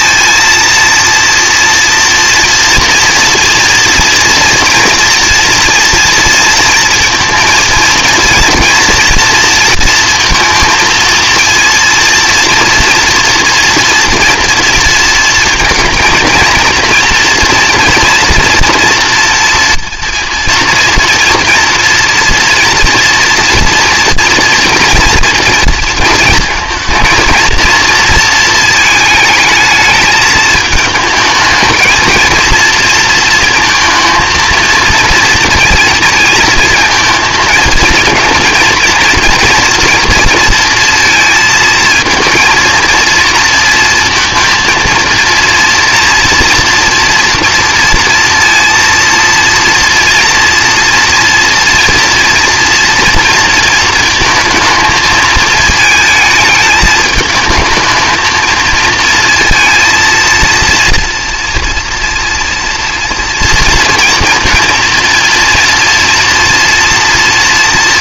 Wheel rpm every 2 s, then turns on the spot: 230, 230, 230, 230, 230, 230, 230, 230, 230, 230, 230, 230, 230, 220, 220, 220, 230, 220, 220, 230, 230, 230, 230, 230, 230, 230, 230, 220, 220, 230, 230, 230, 230, 240.
none